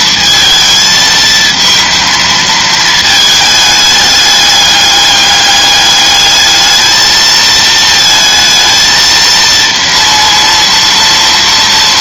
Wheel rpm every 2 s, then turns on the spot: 220, 220, 210, 220, 230, 230.
none